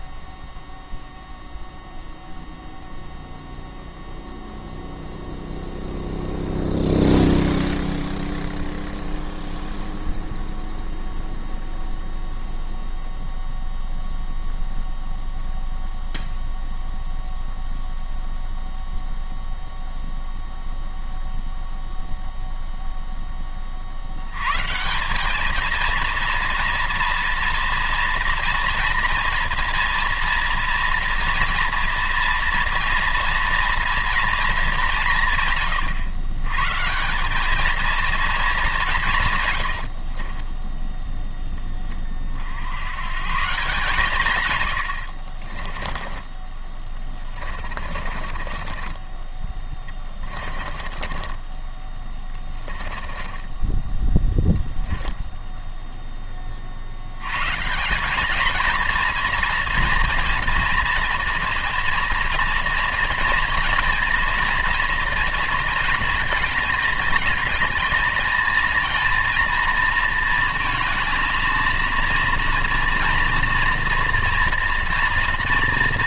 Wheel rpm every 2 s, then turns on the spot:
0, 0, 0, 0, 0, 0, 0, 0, 0, 0, 0, 0, 170, 230, 230, 230, 230, 180, 170, 180, 10, 120, 60, 20, 20, 20, 20, 0, 80, 230, 230, 240, 230, 220, 230, 230, 230, 230.
44-54